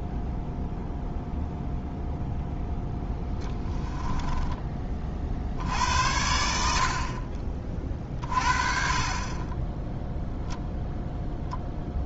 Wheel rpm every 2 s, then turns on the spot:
0, 0, 40, 60, 40, 0.
none